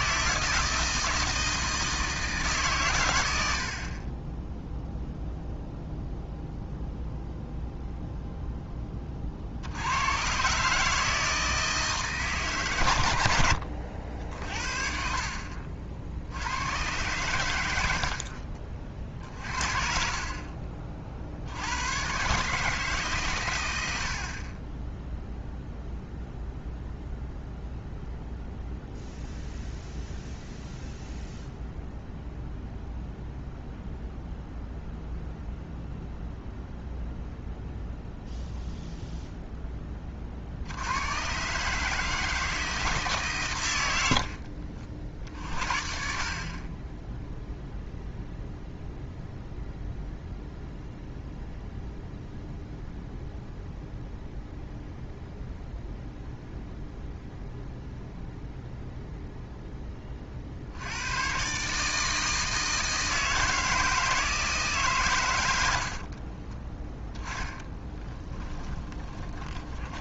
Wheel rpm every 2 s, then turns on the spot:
160, 150, 0, 0, 10, 140, 130, 50, 90, 40, 30, 150, 20, 0, 0, 0, 0, 0, 0, 0, 80, 160, 50, 20, 0, 0, 0, 0, 0, 0, 70, 160, 140, 20, 20.
68-70